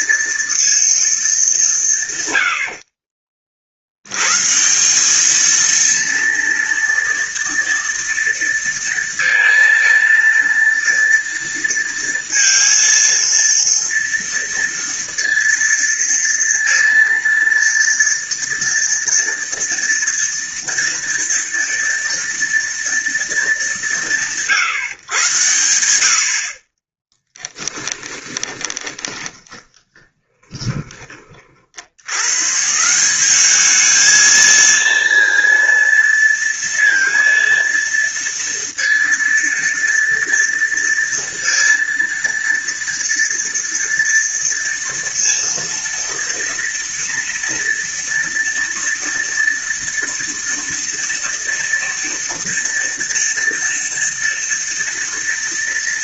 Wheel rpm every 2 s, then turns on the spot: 230, 60, 170, 230, 230, 230, 230, 230, 230, 230, 240, 230, 140, 30, 20, 20, 150, 230, 230, 230, 230, 230, 230, 230, 230, 230, 230, 230.
26-32